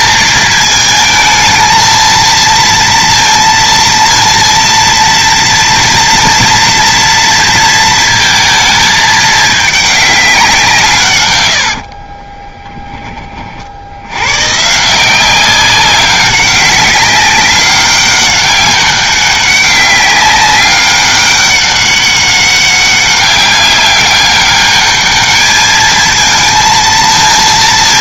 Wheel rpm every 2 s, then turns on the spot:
220, 230, 230, 240, 220, 150, 20, 160, 190, 200, 200, 200, 200, 230.
none